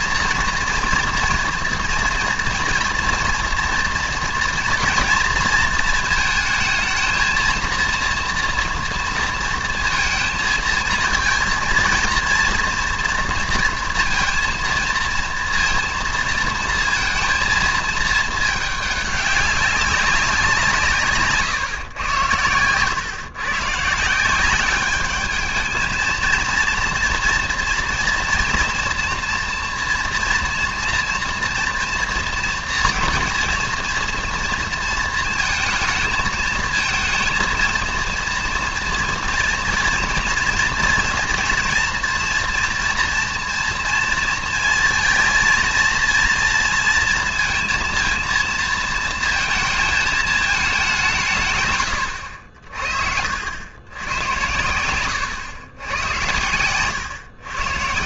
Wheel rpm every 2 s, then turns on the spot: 230, 240, 230, 220, 240, 230, 230, 230, 220, 210, 170, 110, 190, 230, 230, 230, 230, 230, 220, 230, 230, 230, 230, 230, 230, 210, 50, 90, 110.
56-58